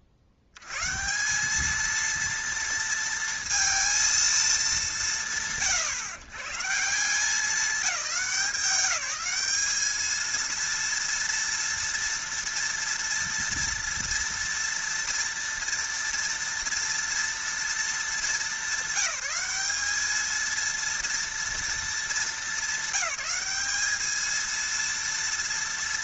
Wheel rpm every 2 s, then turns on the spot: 80, 230, 170, 160, 190, 230, 230, 230, 230, 200, 230, 210, 230.
none